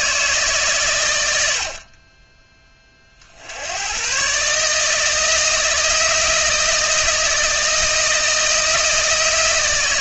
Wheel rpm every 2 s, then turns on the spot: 130, 30, 160, 160, 160.
none